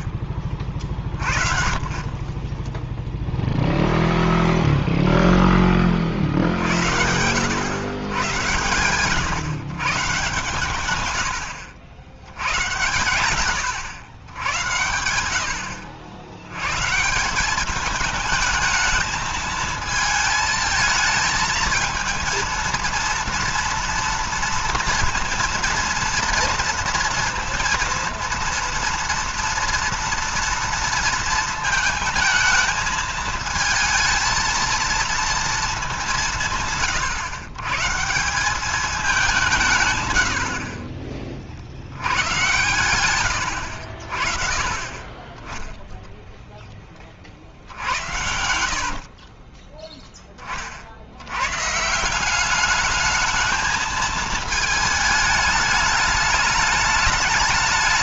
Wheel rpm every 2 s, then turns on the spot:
30, 10, 0, 70, 110, 120, 90, 110, 110, 210, 220, 230, 230, 230, 230, 230, 220, 230, 170, 190, 60, 110, 50, 10, 70, 30, 190, 220, 210.
48-50